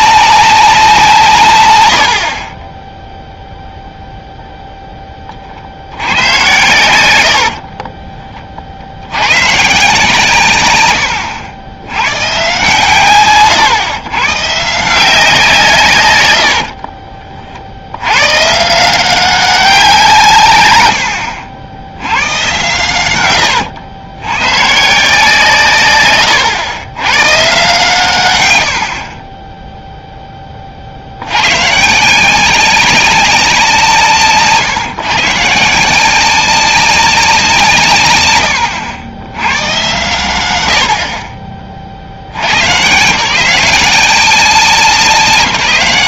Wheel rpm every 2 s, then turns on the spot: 180, 20, 0, 100, 50, 110, 130, 160, 50, 160, 110, 110, 130, 100, 100, 40, 190, 150, 190, 90, 80, 120, 180.
16-18 28-30